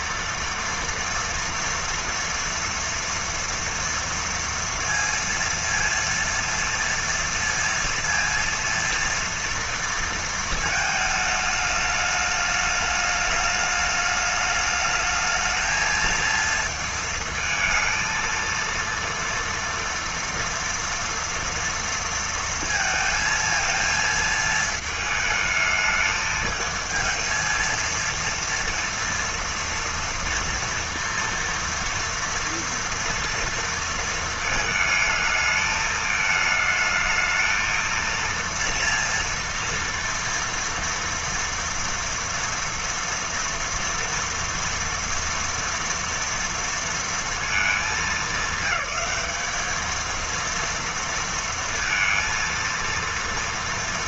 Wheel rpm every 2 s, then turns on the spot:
230, 230, 230, 230, 230, 220, 210, 210, 220, 230, 230, 230, 220, 220, 230, 230, 230, 220, 220, 230, 230, 230, 230, 230, 200, 230, 230.
none